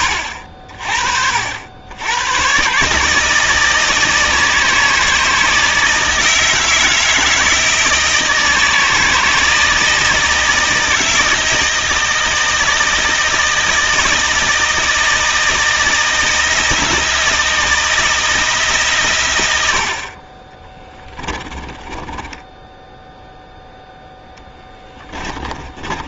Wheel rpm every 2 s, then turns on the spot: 60, 140, 160, 160, 160, 160, 160, 160, 170, 150, 20, 0, 20.
20-22 24-26